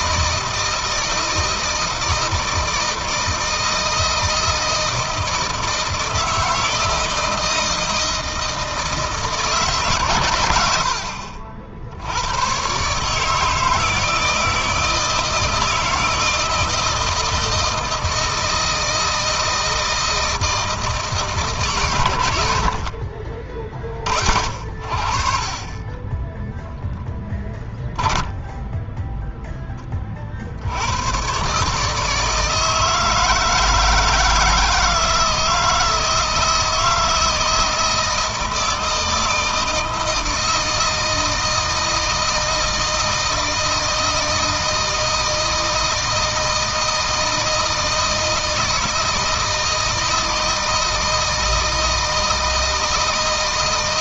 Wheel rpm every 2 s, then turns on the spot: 160, 160, 160, 160, 160, 90, 130, 160, 170, 160, 160, 70, 50, 10, 10, 80, 160, 160, 160, 160, 160, 160, 160, 160, 160, 160, 160.
26-30